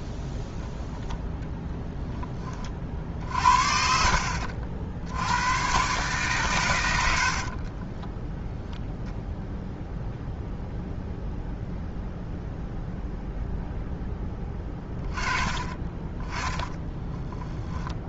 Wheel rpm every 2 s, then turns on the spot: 0, 30, 60, 120, 0, 0, 0, 20, 20.
16-18